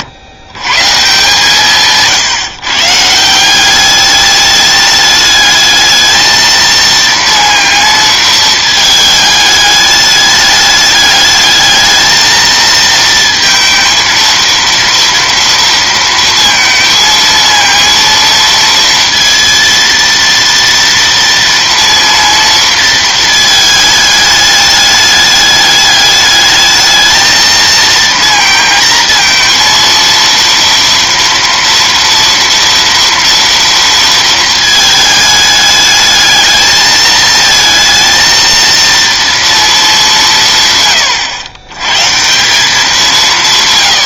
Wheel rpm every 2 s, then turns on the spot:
140, 160, 210, 220, 220, 210, 220, 230, 230, 230, 230, 230, 210, 210, 230, 230, 230, 220, 220, 230, 140, 180.
none